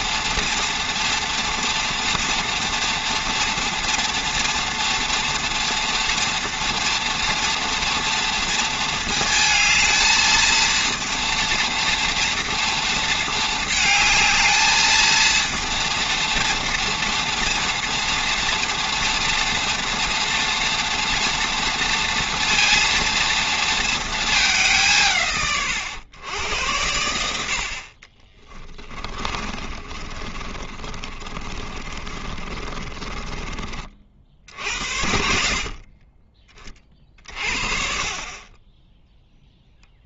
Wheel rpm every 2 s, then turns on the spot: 230, 230, 230, 240, 230, 230, 230, 230, 240, 230, 230, 230, 180, 90, 20, 30, 30, 70, 40, 20.
28-34